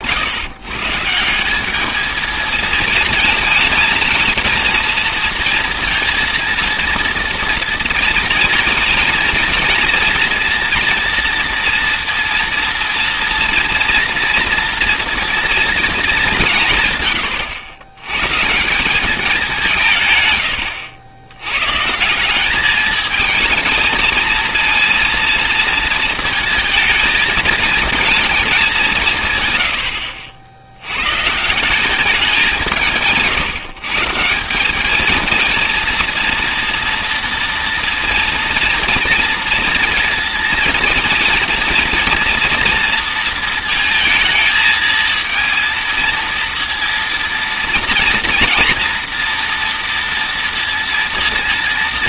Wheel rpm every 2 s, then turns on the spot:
140, 230, 230, 230, 230, 230, 230, 230, 150, 160, 100, 210, 230, 220, 190, 90, 180, 190, 230, 230, 230, 230, 220, 230, 230, 230.
20-22